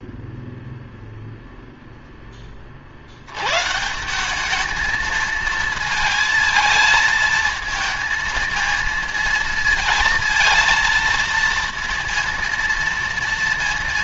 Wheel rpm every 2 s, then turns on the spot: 0, 20, 190, 220, 230, 230, 230.
none